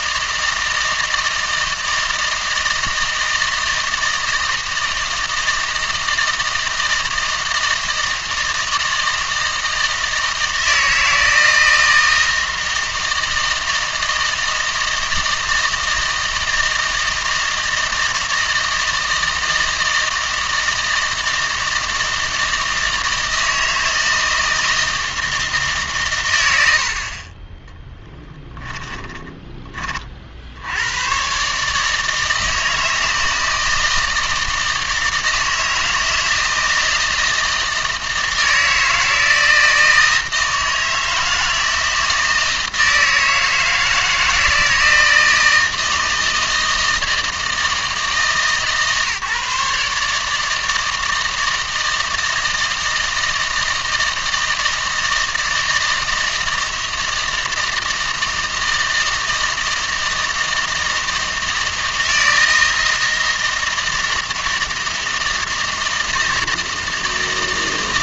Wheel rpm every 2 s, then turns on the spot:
160, 160, 160, 160, 160, 160, 160, 160, 160, 160, 160, 160, 160, 60, 10, 90, 160, 160, 160, 160, 160, 160, 160, 160, 150, 160, 160, 160, 160, 160, 160, 160, 160, 160.
28-30